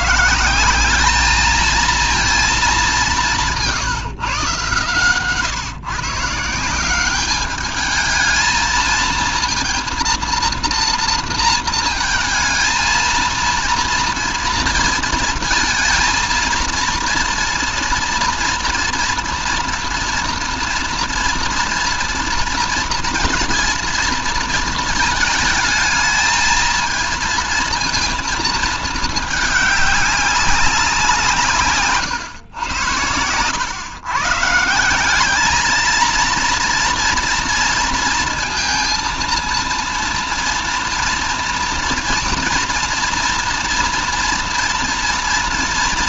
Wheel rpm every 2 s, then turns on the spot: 190, 200, 130, 170, 220, 230, 230, 230, 230, 240, 230, 230, 220, 220, 220, 190, 110, 160, 230, 230, 230, 230, 240.
none